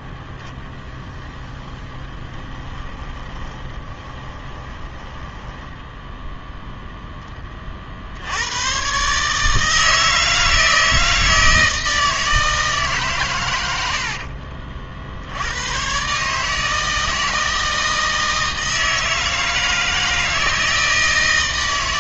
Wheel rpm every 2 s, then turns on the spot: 0, 20, 20, 0, 100, 160, 160, 50, 150, 160, 160.
2-6